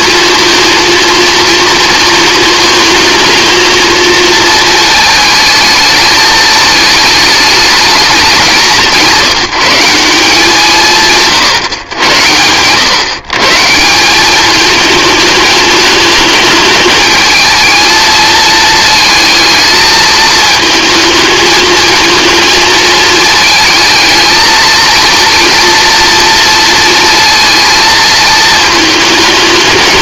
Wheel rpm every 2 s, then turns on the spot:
230, 220, 220, 210, 190, 170, 110, 210, 220, 230, 220, 220, 230, 230, 220.
none